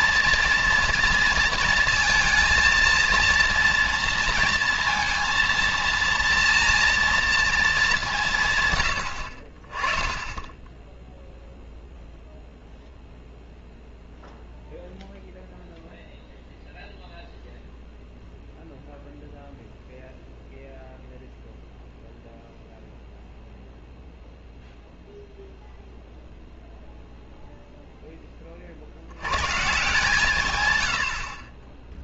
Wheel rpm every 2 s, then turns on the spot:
230, 230, 230, 230, 60, 0, 0, 0, 0, 0, 0, 0, 0, 0, 130, 30.
none